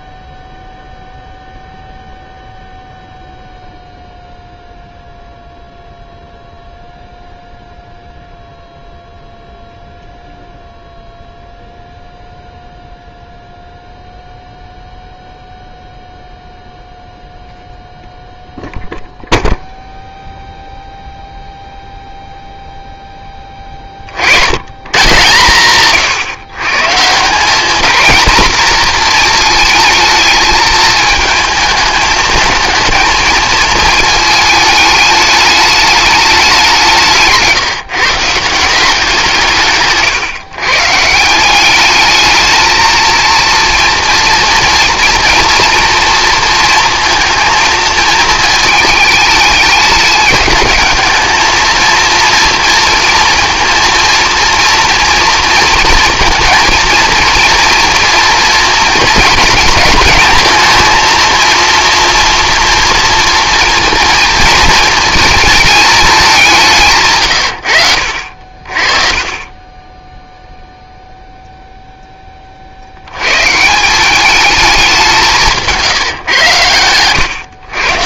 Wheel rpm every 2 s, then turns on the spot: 0, 0, 0, 0, 0, 0, 0, 0, 0, 0, 0, 0, 90, 130, 230, 220, 220, 220, 190, 160, 140, 220, 230, 230, 220, 210, 230, 230, 230, 230, 230, 240, 230, 190, 50, 0, 40, 200, 110.
none